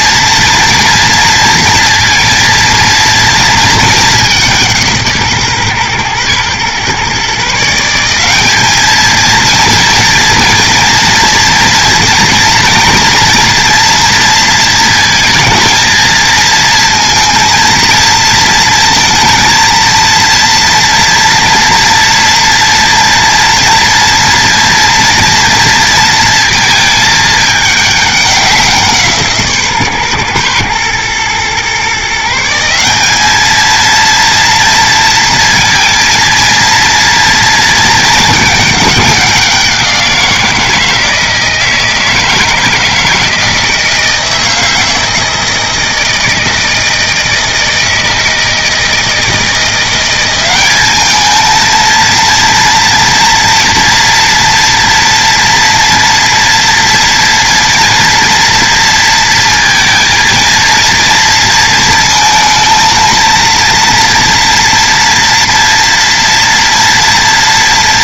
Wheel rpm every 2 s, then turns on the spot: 240, 230, 170, 120, 210, 230, 230, 230, 230, 230, 230, 230, 230, 230, 180, 120, 170, 230, 230, 210, 170, 160, 160, 160, 160, 200, 230, 240, 230, 230, 230, 230, 230, 230.
none